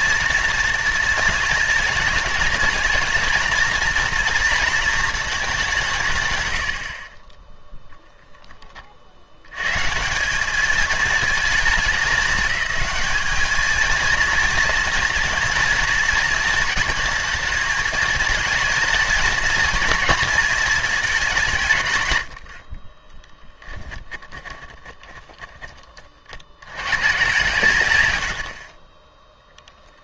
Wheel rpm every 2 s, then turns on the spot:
230, 220, 230, 60, 30, 220, 210, 230, 220, 230, 220, 40, 10, 170, 30.
22-26